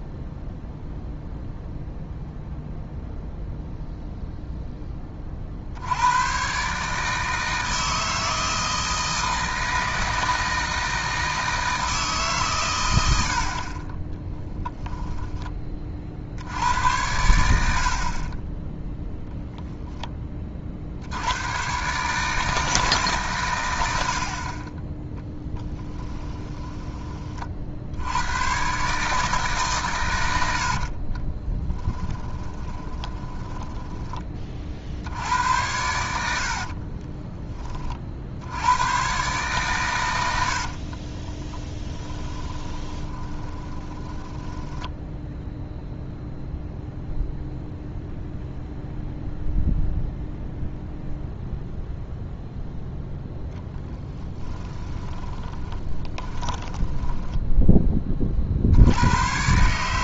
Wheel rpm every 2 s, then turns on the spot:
0, 0, 10, 140, 160, 160, 110, 10, 90, 10, 60, 150, 20, 10, 130, 70, 20, 50, 50, 100, 60, 20, 10, 0, 0, 0, 0, 20, 10, 70.
26-28 30-34 36-38 40-46 54-58